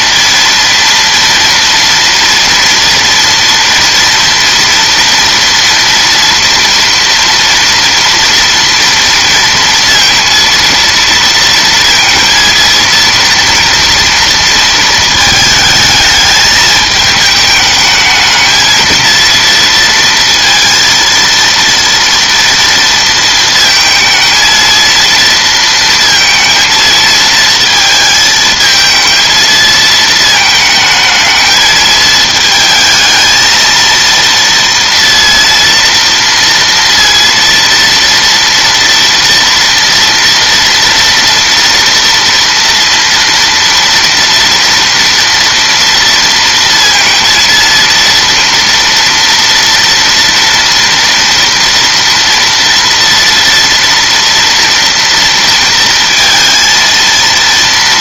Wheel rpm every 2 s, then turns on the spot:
230, 230, 230, 230, 230, 230, 230, 230, 220, 220, 230, 230, 230, 230, 230, 220, 220, 230, 230, 230, 230, 230, 230, 230, 230, 230, 230, 230, 230.
none